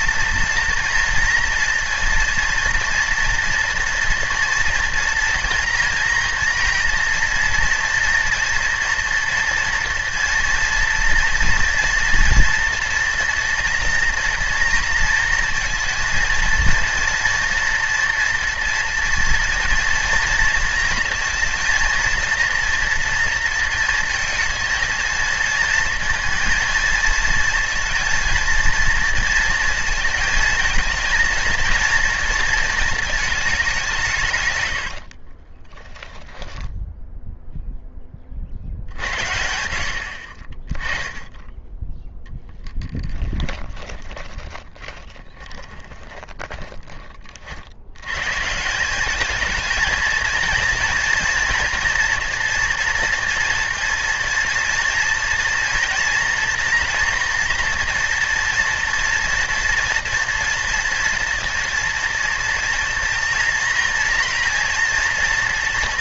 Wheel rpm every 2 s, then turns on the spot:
240, 230, 230, 230, 230, 230, 240, 240, 230, 230, 230, 230, 230, 230, 230, 220, 230, 90, 10, 70, 10, 10, 20, 40, 180, 230, 230, 230, 240, 240, 230, 230, 230.
34-36 42-48